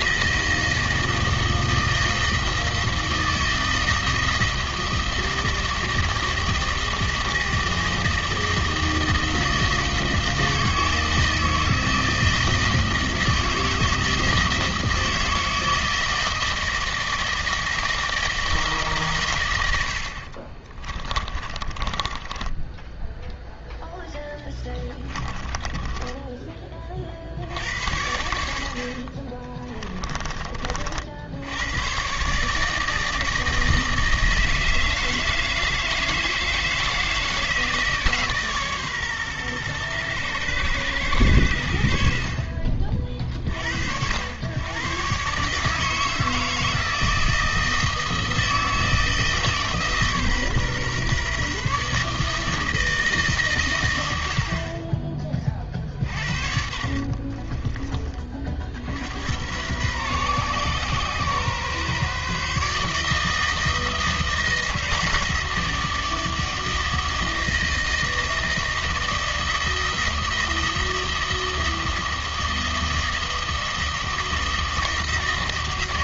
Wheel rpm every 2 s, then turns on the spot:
160, 160, 160, 160, 160, 160, 160, 160, 160, 150, 30, 10, 10, 30, 70, 40, 150, 160, 160, 140, 110, 50, 120, 160, 160, 140, 160, 50, 50, 60, 130, 150, 160, 160, 160, 160, 160, 160.
20-26 28-30 56-58